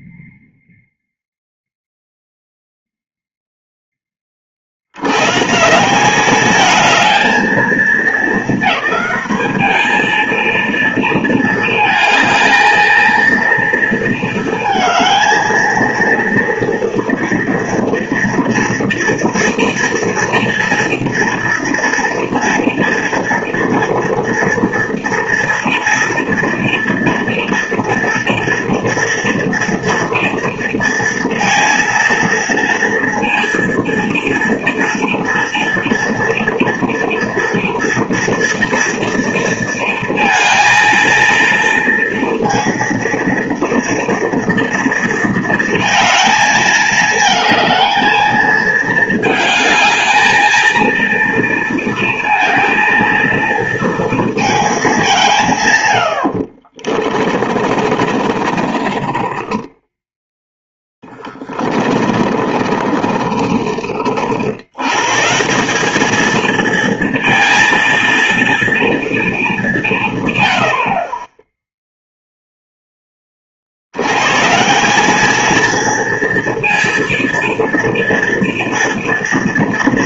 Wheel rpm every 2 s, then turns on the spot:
0, 0, 40, 210, 220, 230, 220, 220, 230, 230, 230, 230, 230, 230, 230, 230, 230, 230, 230, 230, 230, 230, 230, 220, 220, 220, 230, 220, 50, 30, 10, 30, 80, 230, 230, 100, 0, 150, 230, 230.
56-64